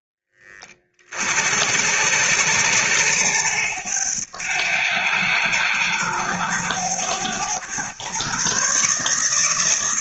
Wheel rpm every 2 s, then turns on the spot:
30, 100, 100, 100, 140.
none